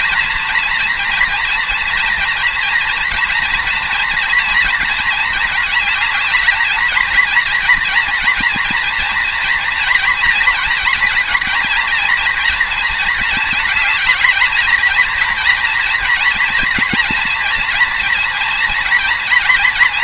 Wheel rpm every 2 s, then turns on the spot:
230, 240, 230, 220, 230, 230, 230, 220, 230, 230.
none